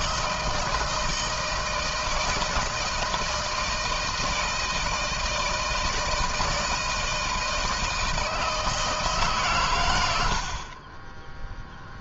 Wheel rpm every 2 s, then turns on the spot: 160, 160, 160, 160, 160, 30.
10-12